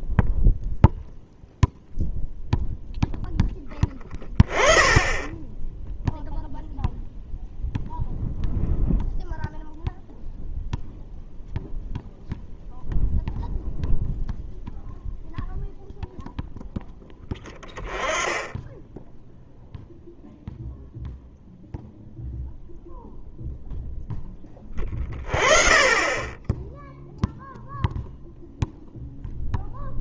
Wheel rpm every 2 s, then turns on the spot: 0, 0, 10, 0, 0, 0, 0, 0, 10, 0, 0, 0, 20, 0, 0.
none